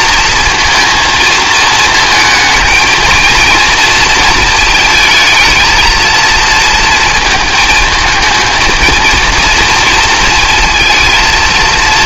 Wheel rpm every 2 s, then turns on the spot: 230, 220, 230, 230, 220, 230.
none